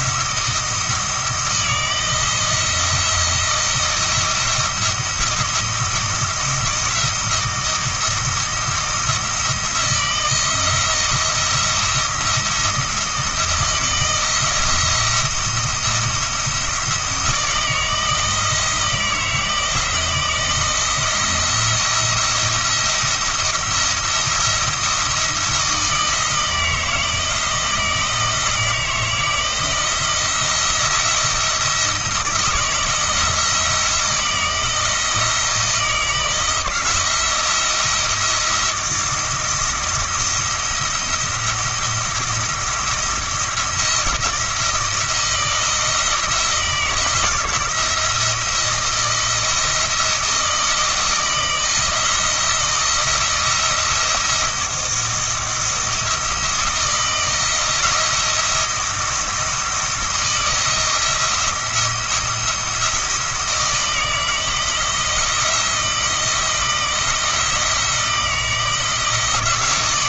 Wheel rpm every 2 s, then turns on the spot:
170, 170, 170, 160, 170, 170, 170, 170, 160, 160, 170, 170, 170, 170, 160, 170, 160, 160, 160, 170, 170, 170, 170, 170, 170, 160, 170, 170, 170, 170, 160, 170, 170, 170, 160.
none